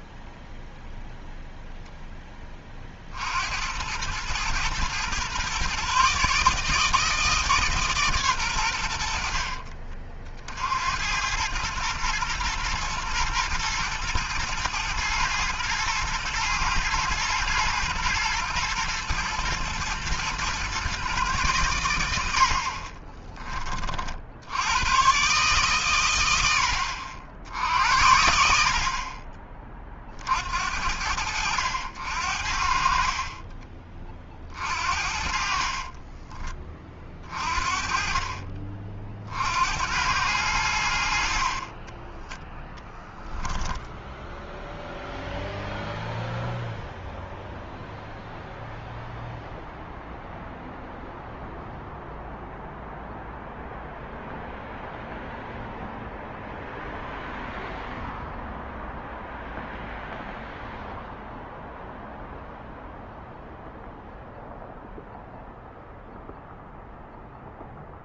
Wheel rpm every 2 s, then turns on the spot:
0, 50, 120, 160, 70, 90, 120, 120, 110, 110, 130, 30, 120, 80, 40, 80, 40, 50, 40, 50, 70, 0, 0, 0, 0, 0, 0, 0, 0, 0, 0, 0, 0, 0.
22-24